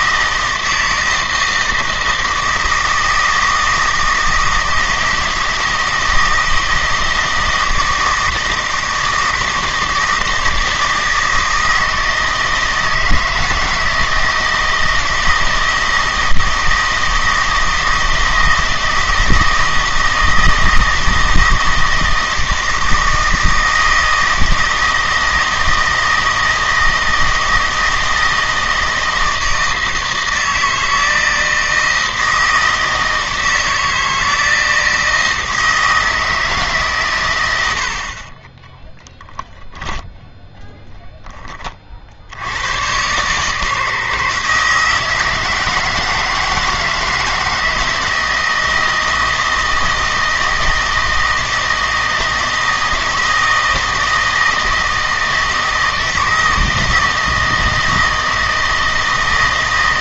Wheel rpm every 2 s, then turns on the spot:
160, 160, 160, 160, 160, 160, 160, 160, 160, 160, 160, 160, 160, 160, 160, 160, 160, 160, 140, 20, 0, 110, 160, 160, 160, 160, 160, 160, 160, 160.
38-40